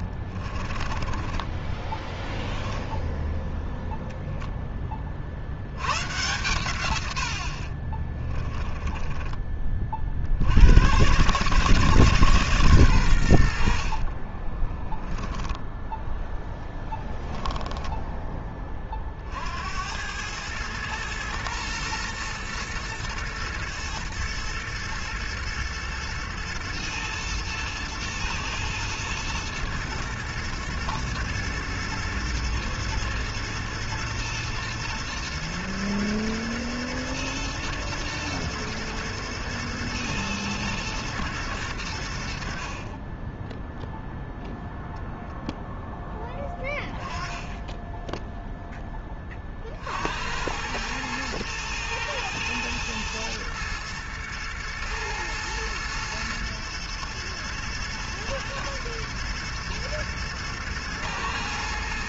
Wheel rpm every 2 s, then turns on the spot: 40, 10, 10, 130, 10, 80, 140, 20, 10, 20, 110, 120, 110, 110, 110, 120, 110, 120, 110, 110, 110, 60, 0, 10, 10, 100, 110, 120, 120, 110, 110.
0-2 8-10 14-16